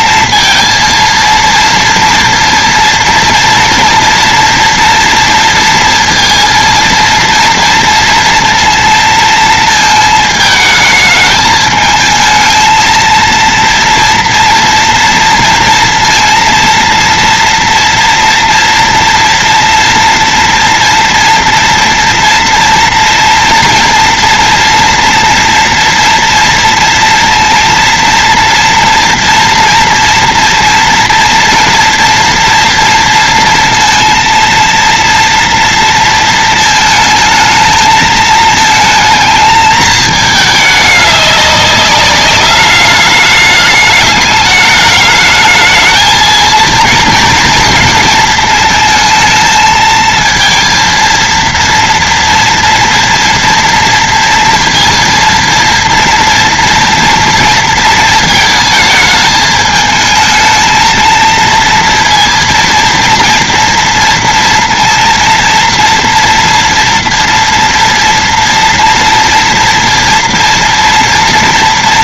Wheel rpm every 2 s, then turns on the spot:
230, 230, 230, 230, 230, 220, 220, 230, 230, 230, 230, 230, 240, 230, 240, 230, 230, 230, 230, 220, 210, 200, 210, 230, 230, 230, 230, 230, 230, 220, 220, 230, 230, 230, 230, 230.
none